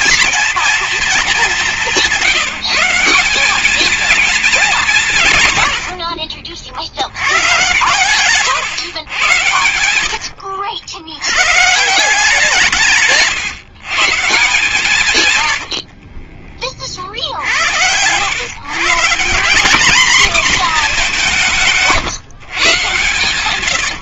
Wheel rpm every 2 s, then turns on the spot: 230, 200, 220, 100, 120, 80, 170, 150, 40, 110, 240, 140.
6-12 16-18